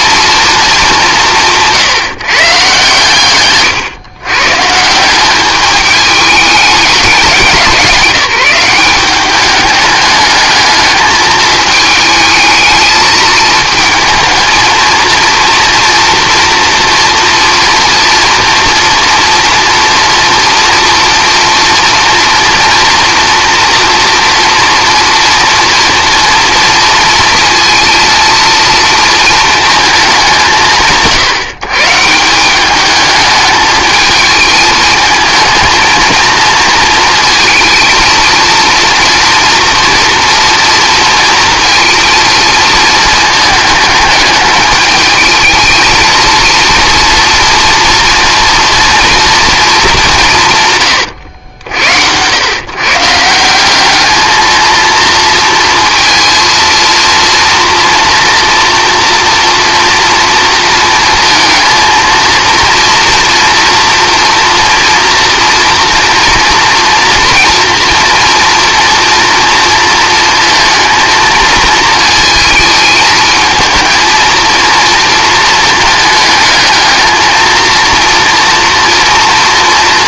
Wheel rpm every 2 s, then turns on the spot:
220, 140, 140, 200, 180, 210, 220, 230, 240, 240, 240, 240, 230, 230, 230, 150, 200, 220, 230, 230, 230, 220, 210, 230, 230, 140, 130, 230, 230, 230, 230, 230, 230, 230, 230, 230, 220, 230, 220, 230.
none